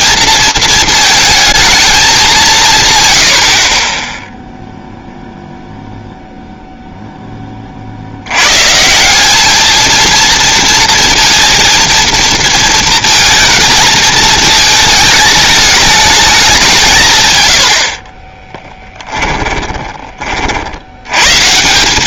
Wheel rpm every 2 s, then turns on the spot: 230, 150, 0, 0, 120, 230, 230, 220, 190, 10, 70.
18-20